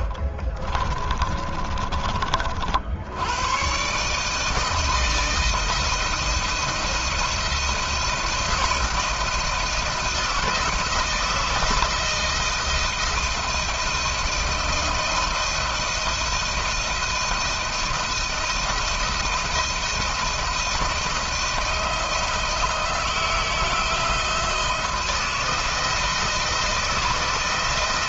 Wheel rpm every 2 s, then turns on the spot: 40, 60, 160, 170, 170, 160, 160, 160, 160, 170, 170, 160, 160, 160.
0-2